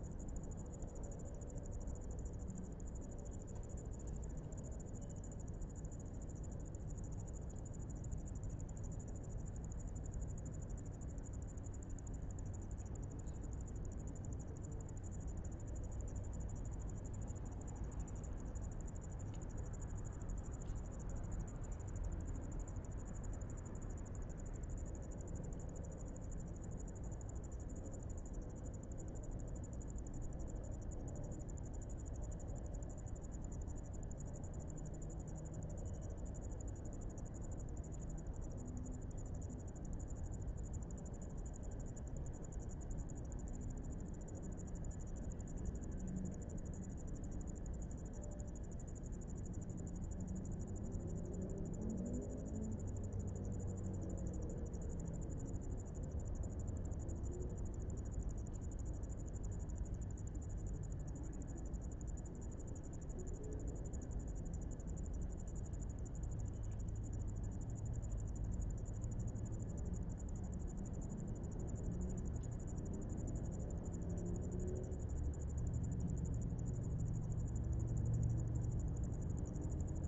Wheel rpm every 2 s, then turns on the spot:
0, 0, 0, 0, 0, 0, 0, 0, 0, 0, 0, 0, 0, 0, 0, 0, 0, 0, 0, 0, 0, 0, 0, 0, 0, 0, 0, 0, 0, 0, 0, 0, 0, 0, 0, 0, 0, 0, 0, 0.
none